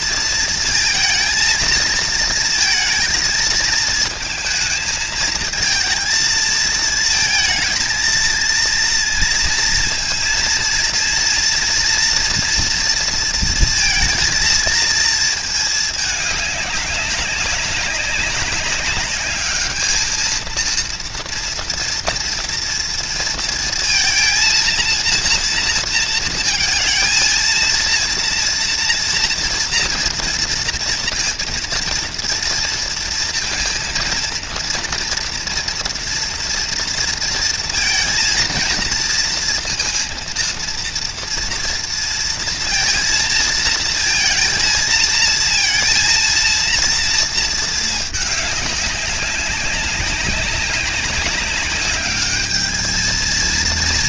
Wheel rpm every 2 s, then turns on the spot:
230, 220, 220, 220, 230, 230, 230, 230, 200, 200, 220, 230, 230, 220, 230, 230, 230, 230, 230, 230, 230, 230, 230, 230, 200, 190, 210.
none